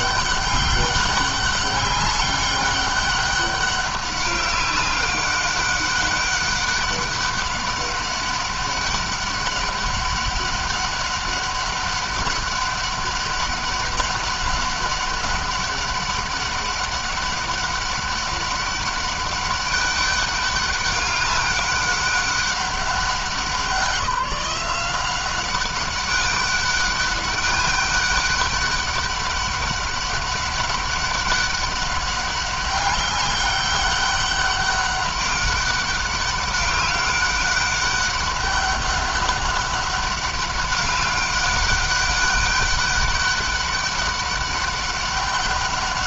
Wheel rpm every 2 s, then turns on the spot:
200, 200, 200, 200, 200, 200, 200, 200, 200, 190, 200, 200, 180, 200, 200, 200, 200, 200, 200, 200, 200, 200, 200.
none